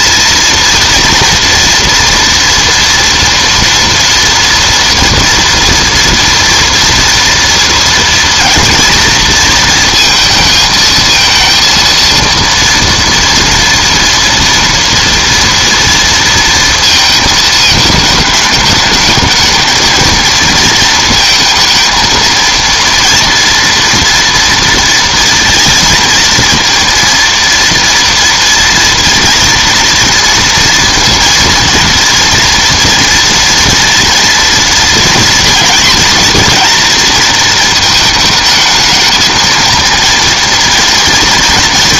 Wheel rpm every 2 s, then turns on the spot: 230, 230, 230, 240, 230, 220, 230, 230, 230, 210, 230, 230, 230, 230, 240, 230, 230, 230, 230, 220, 230.
none